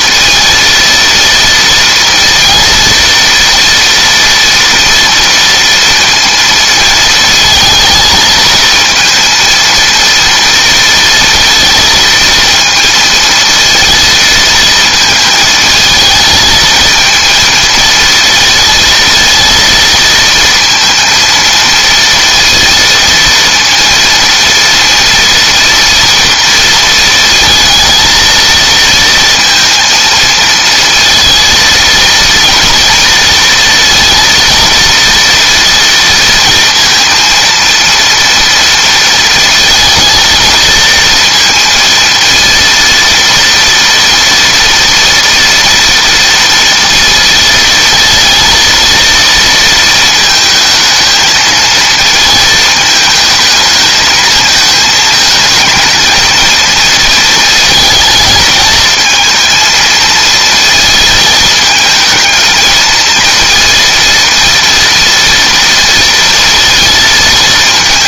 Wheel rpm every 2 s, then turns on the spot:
230, 230, 230, 230, 220, 230, 230, 230, 220, 230, 230, 230, 230, 230, 230, 230, 230, 230, 230, 230, 230, 230, 240, 230, 230, 220, 220, 220, 230, 220, 220, 230, 230, 230.
none